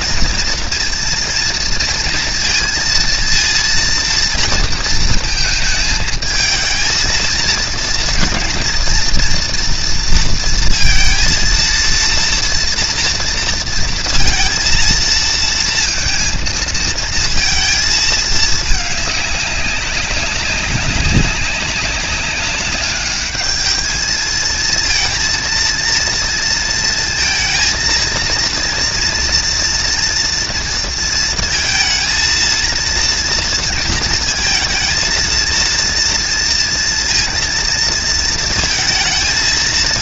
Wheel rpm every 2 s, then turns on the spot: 230, 230, 230, 220, 230, 230, 230, 230, 220, 210, 200, 200, 230, 230, 230, 230, 230, 230, 230, 220.
none